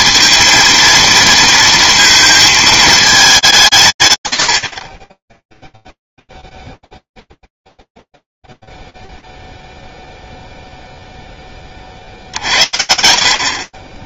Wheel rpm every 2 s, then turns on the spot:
230, 220, 60, 0, 0, 0, 50.
none